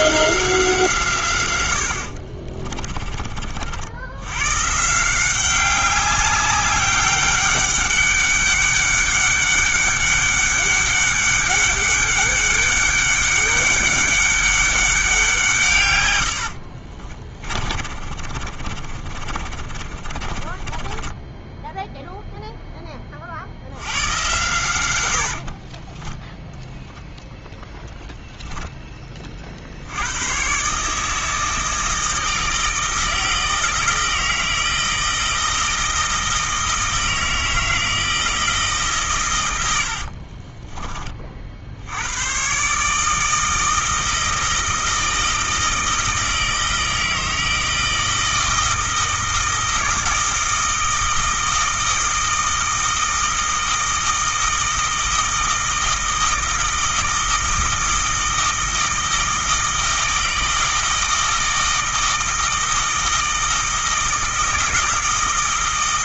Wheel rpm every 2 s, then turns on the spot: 160, 30, 150, 200, 200, 200, 200, 190, 50, 40, 20, 20, 100, 0, 10, 150, 160, 160, 160, 140, 20, 150, 160, 160, 160, 160, 160, 160, 160, 160, 160, 160, 160.
2-4 16-22